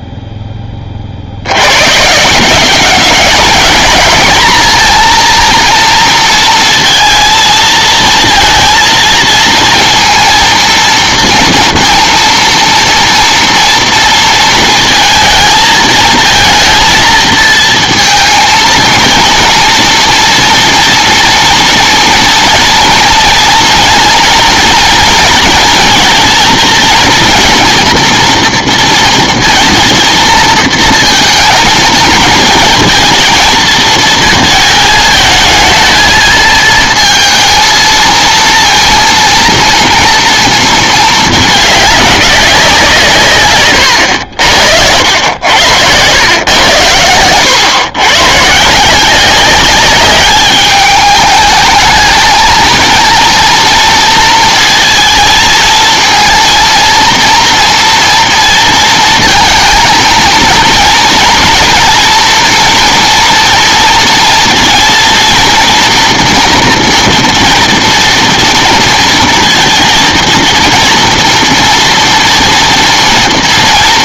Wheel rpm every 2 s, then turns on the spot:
10, 190, 230, 230, 230, 230, 230, 230, 230, 230, 230, 230, 230, 230, 230, 230, 230, 220, 230, 230, 230, 190, 80, 100, 140, 210, 220, 230, 230, 230, 220, 230, 230, 240, 240, 230, 230.
none